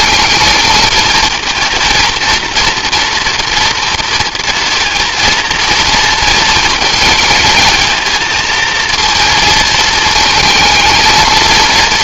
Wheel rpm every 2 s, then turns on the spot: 230, 230, 230, 220, 220, 230.
none